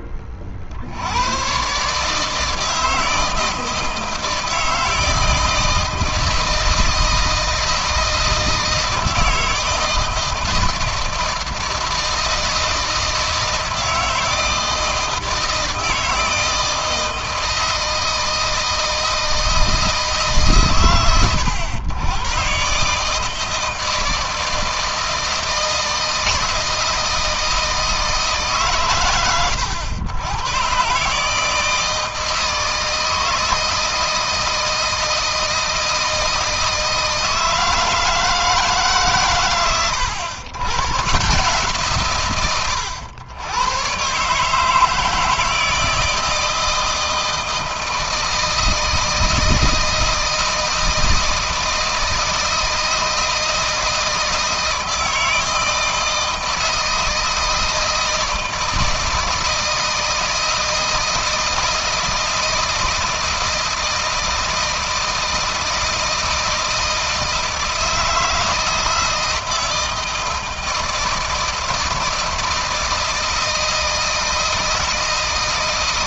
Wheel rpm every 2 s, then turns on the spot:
40, 160, 160, 160, 160, 160, 160, 160, 160, 160, 130, 140, 160, 160, 110, 130, 160, 160, 160, 150, 120, 100, 150, 160, 160, 160, 160, 160, 160, 160, 160, 160, 160, 160, 160, 160, 160, 160.
none